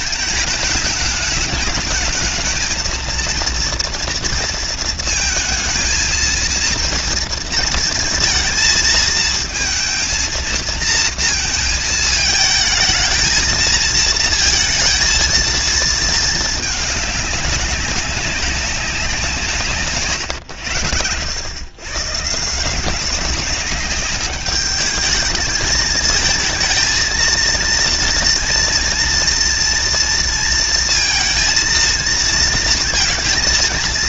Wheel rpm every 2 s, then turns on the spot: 220, 220, 230, 230, 230, 230, 220, 230, 220, 190, 100, 160, 210, 220, 230, 230, 230.
none